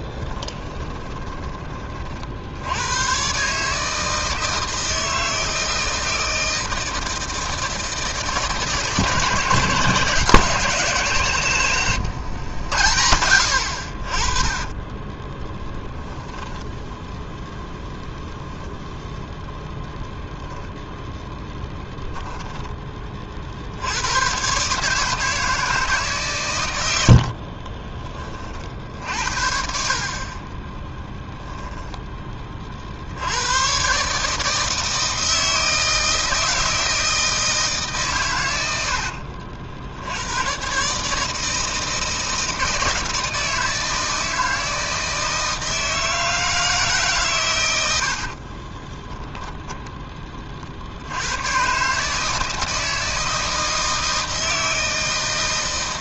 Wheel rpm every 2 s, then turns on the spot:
20, 100, 160, 160, 150, 160, 90, 20, 10, 0, 0, 20, 150, 90, 60, 10, 50, 160, 160, 70, 140, 160, 160, 150, 20, 70, 160, 160.
0-2 38-40 48-50